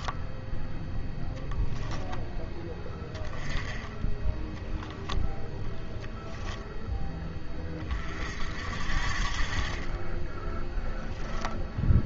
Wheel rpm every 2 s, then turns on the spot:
0, 10, 10, 0, 50, 10.
none